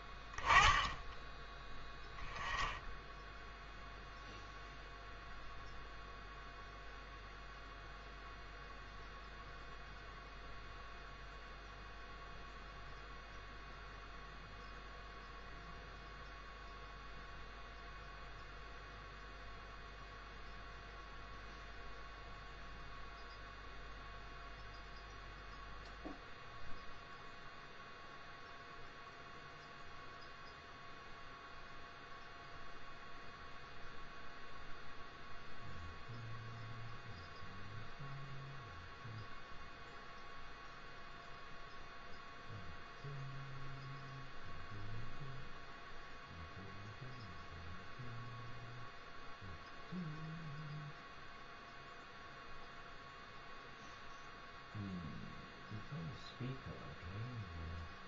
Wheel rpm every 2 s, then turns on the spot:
10, 10, 0, 0, 0, 0, 0, 0, 0, 0, 0, 0, 0, 0, 0, 0, 0, 0, 0, 0, 0, 0, 0, 0, 0, 0, 0, 0, 0.
none